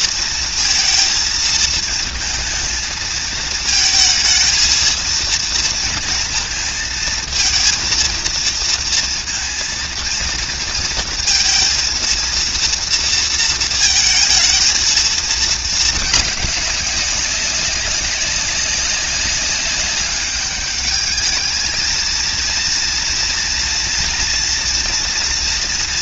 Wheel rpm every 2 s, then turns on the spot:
230, 230, 230, 220, 220, 230, 230, 220, 200, 200, 210, 230, 230.
none